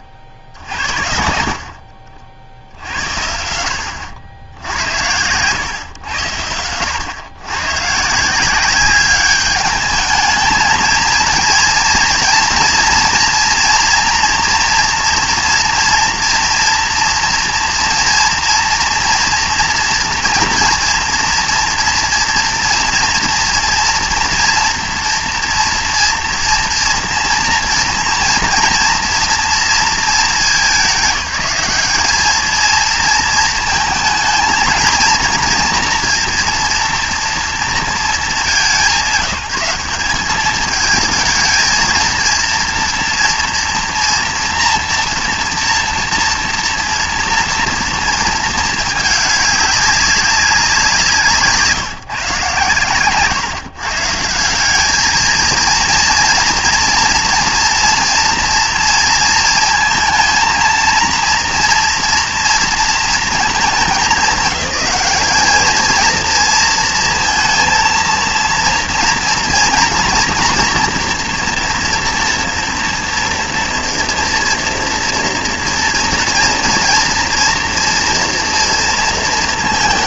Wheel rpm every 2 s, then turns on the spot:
60, 70, 80, 90, 180, 220, 230, 230, 230, 230, 230, 230, 230, 230, 230, 210, 220, 230, 230, 180, 210, 230, 230, 230, 220, 190, 140, 180, 230, 230, 230, 230, 200, 230, 230, 240, 230, 230, 230, 230.
none